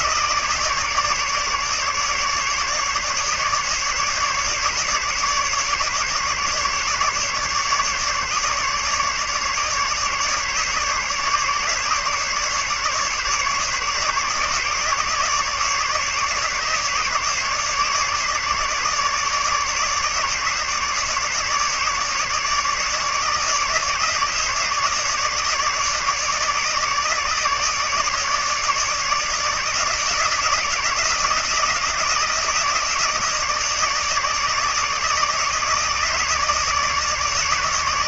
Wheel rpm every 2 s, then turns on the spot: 150, 150, 150, 150, 150, 150, 150, 150, 150, 150, 150, 150, 150, 150, 160, 160, 160, 150, 150.
none